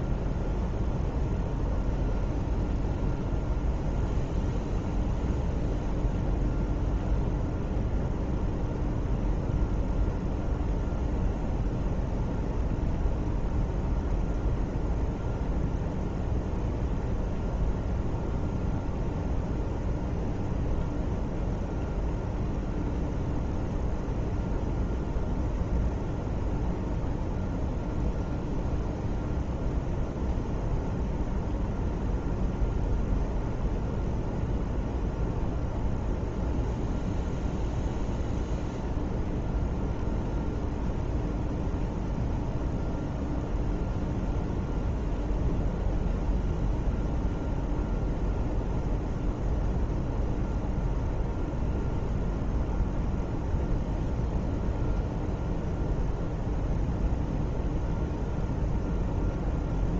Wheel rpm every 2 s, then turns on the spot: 0, 0, 0, 0, 0, 0, 0, 0, 0, 0, 0, 0, 0, 0, 0, 0, 0, 0, 0, 0, 0, 0, 0, 0, 0, 0, 0, 0, 0, 0.
none